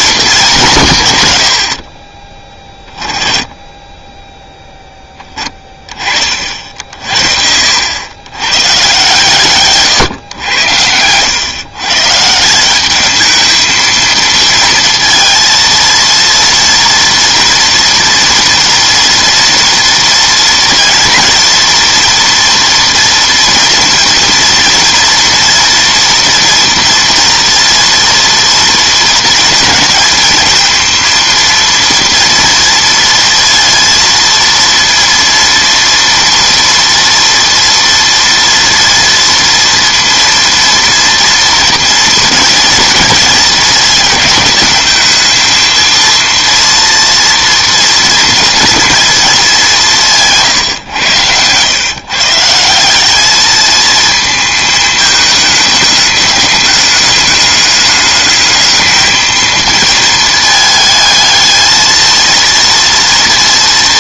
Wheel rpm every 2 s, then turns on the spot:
180, 20, 10, 50, 130, 90, 180, 230, 230, 230, 230, 230, 230, 230, 230, 230, 230, 230, 230, 230, 230, 230, 220, 230, 230, 140, 160, 220, 210, 220, 220, 230.
none